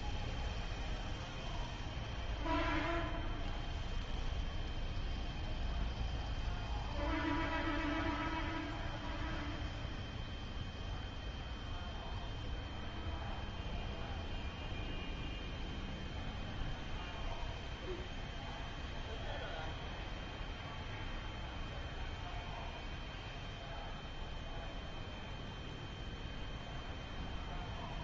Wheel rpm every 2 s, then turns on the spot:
0, 0, 0, 0, 0, 0, 0, 0, 0, 0, 0, 0, 0, 0.
none